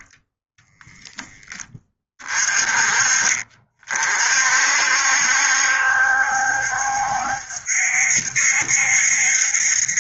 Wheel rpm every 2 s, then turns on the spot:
10, 40, 70, 70, 70.
none